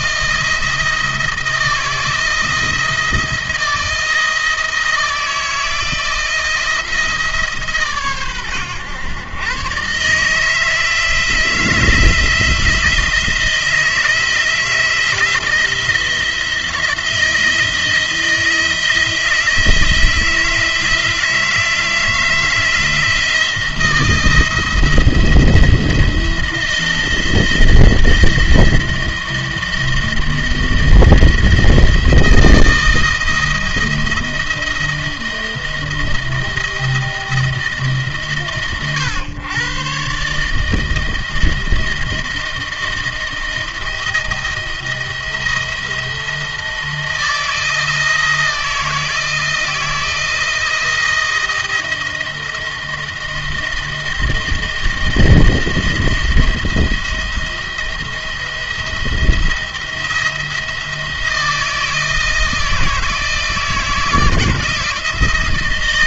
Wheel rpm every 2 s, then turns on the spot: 170, 160, 170, 160, 120, 160, 170, 170, 170, 160, 160, 160, 170, 170, 170, 160, 170, 170, 160, 130, 150, 170, 170, 160, 160, 170, 170, 170, 170, 170, 170, 160, 160.
none